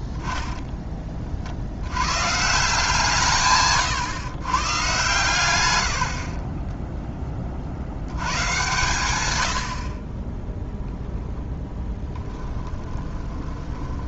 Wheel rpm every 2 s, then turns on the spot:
20, 180, 120, 10, 130, 0, 20.
12-14